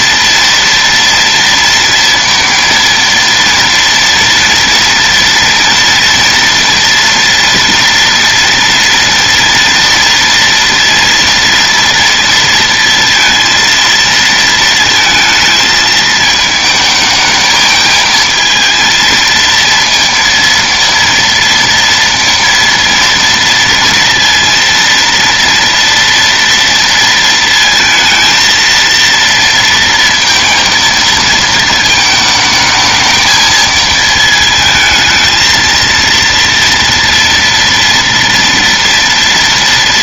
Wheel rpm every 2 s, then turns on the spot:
230, 230, 230, 230, 240, 230, 230, 220, 220, 220, 230, 230, 230, 230, 230, 230, 220, 220, 230, 230.
none